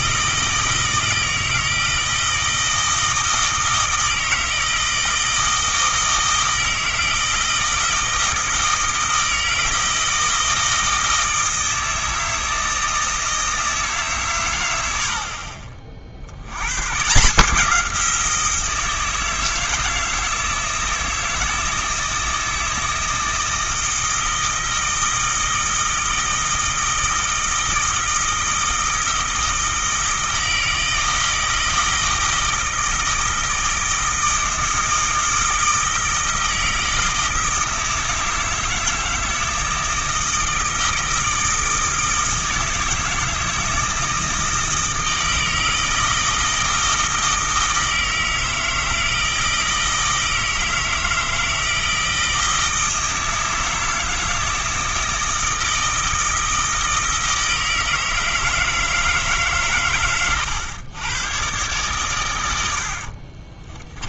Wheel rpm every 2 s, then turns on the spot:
160, 160, 160, 160, 160, 160, 160, 80, 120, 160, 160, 160, 160, 160, 160, 160, 160, 160, 160, 160, 160, 160, 160, 160, 160, 160, 160, 160, 160, 160, 120, 70.
62-64